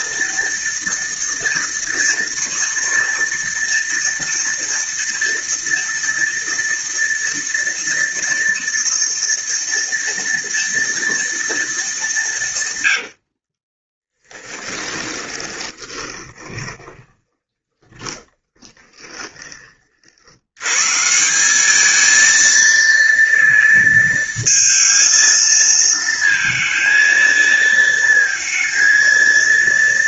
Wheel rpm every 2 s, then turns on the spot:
230, 230, 230, 230, 230, 230, 110, 20, 30, 10, 130, 230, 230, 230, 230.
12-20